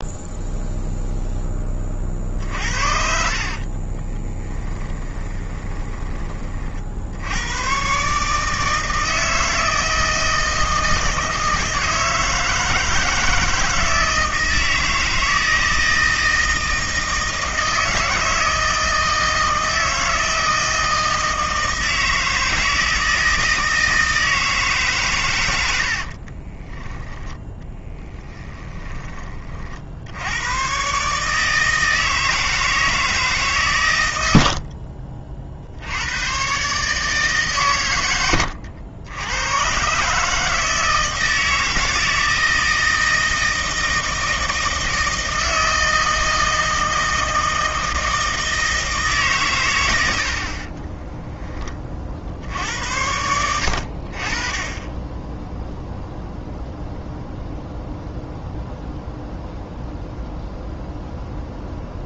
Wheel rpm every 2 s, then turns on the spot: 0, 60, 20, 70, 160, 160, 160, 160, 160, 160, 160, 160, 130, 20, 20, 140, 160, 30, 140, 80, 160, 160, 160, 160, 150, 30, 80, 10, 0, 0, 0.
2-6 26-28 50-52